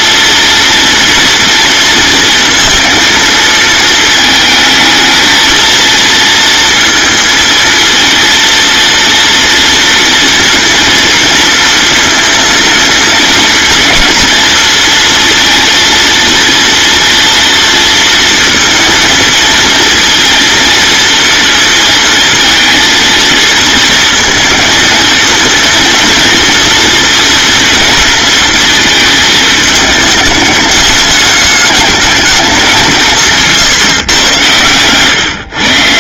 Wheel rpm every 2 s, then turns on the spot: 240, 230, 230, 220, 230, 230, 220, 230, 230, 230, 230, 230, 230, 230, 210, 210, 170, 130.
none